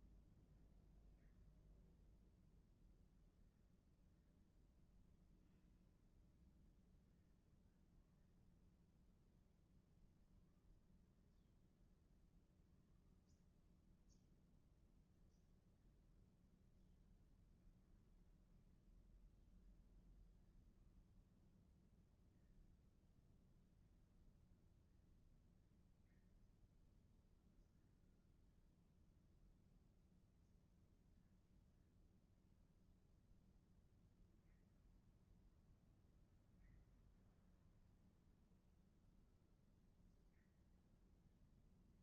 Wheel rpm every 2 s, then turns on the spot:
0, 0, 0, 0, 0, 0, 0, 0, 0, 0, 0, 0, 0, 0, 0, 0, 0, 0, 0, 0, 0.
none